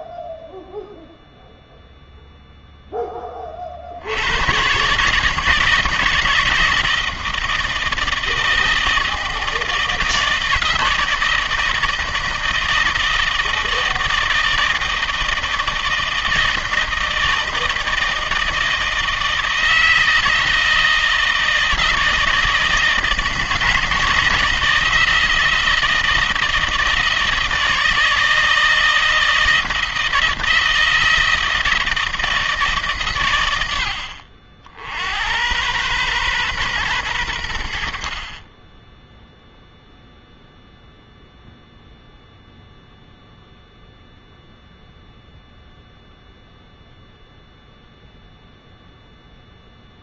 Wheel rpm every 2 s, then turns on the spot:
0, 10, 130, 160, 160, 160, 160, 160, 160, 160, 160, 160, 160, 160, 160, 160, 150, 70, 120, 10, 0, 0, 0, 0, 0.
none